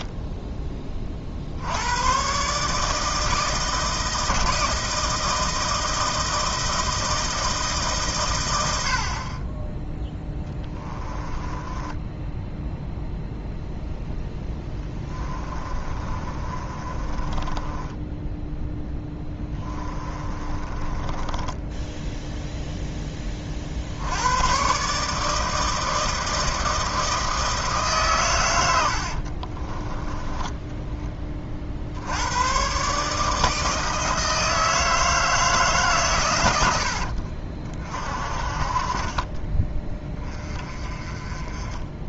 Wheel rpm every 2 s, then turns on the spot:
20, 140, 160, 160, 90, 10, 0, 10, 30, 10, 20, 0, 130, 160, 90, 10, 130, 160, 90, 40, 30.
10-12 14-22 30-32 36-38